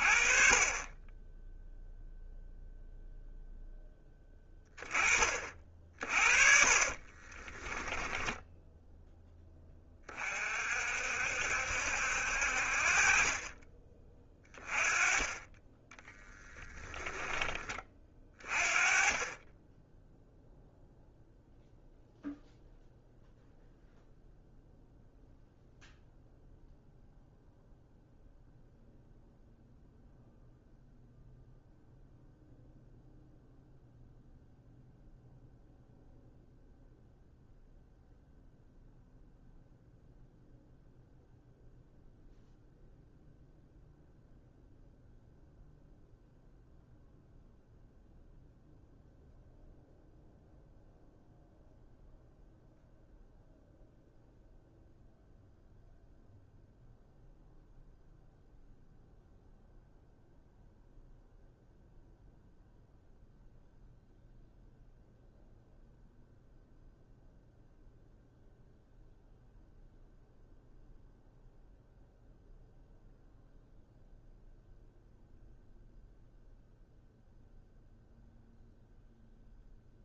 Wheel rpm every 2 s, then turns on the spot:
20, 0, 20, 50, 10, 50, 50, 20, 20, 30, 0, 0, 0, 0, 0, 0, 0, 0, 0, 0, 0, 0, 0, 0, 0, 0, 0, 0, 0, 0, 0, 0, 0, 0, 0, 0, 0, 0, 0, 0.
6-8 16-18